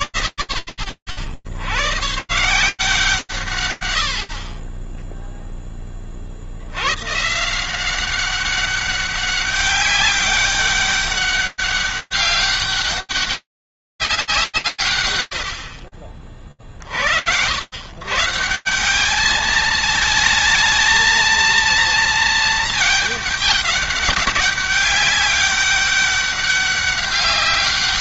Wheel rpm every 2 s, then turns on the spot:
100, 180, 20, 100, 190, 200, 200, 130, 60, 200, 220, 210, 200, 200.
none